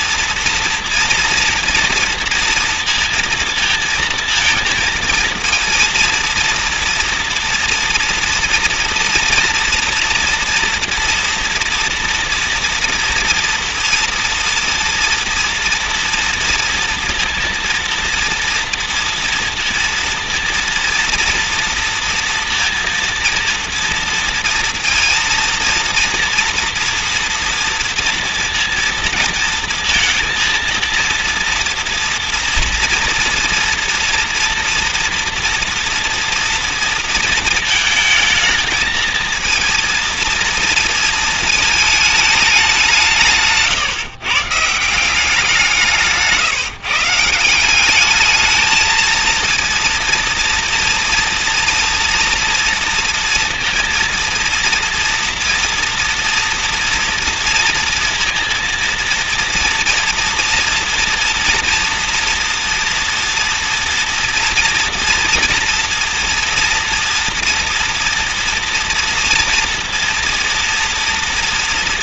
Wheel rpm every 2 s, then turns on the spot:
230, 230, 230, 230, 230, 230, 230, 230, 230, 230, 230, 230, 230, 240, 230, 230, 230, 240, 230, 220, 230, 200, 160, 150, 210, 230, 230, 230, 230, 230, 230, 230, 240, 230, 230, 230.
none